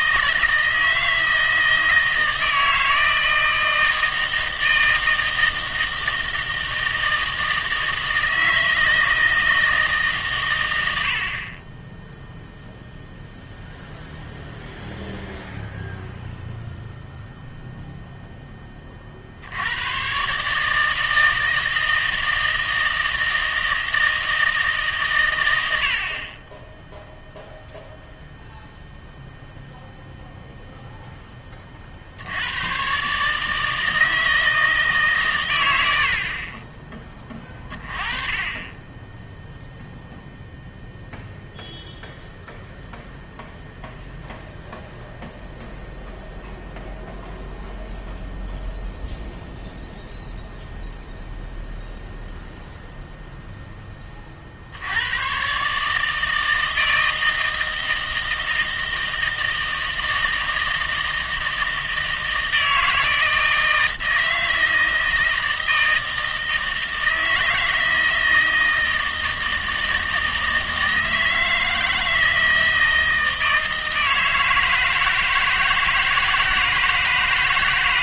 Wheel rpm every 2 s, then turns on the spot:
160, 160, 160, 160, 160, 100, 0, 0, 0, 20, 150, 160, 150, 10, 0, 0, 120, 160, 30, 20, 0, 0, 0, 0, 0, 0, 0, 70, 160, 160, 160, 160, 160, 160, 160, 160, 160, 160, 160.
none